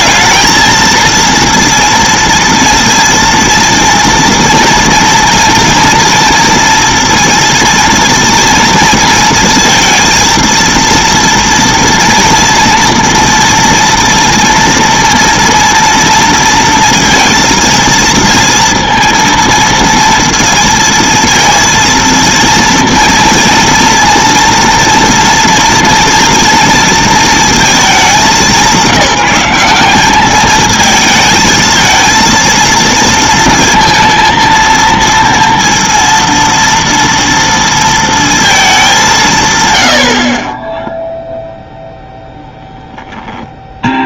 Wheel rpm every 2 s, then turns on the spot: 230, 230, 230, 230, 230, 230, 240, 230, 230, 230, 230, 230, 230, 230, 190, 220, 230, 230, 230, 210, 10, 0.
none